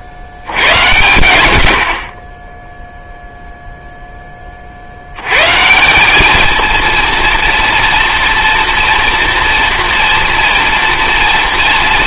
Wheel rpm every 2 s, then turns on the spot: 80, 0, 40, 230, 230, 230.
none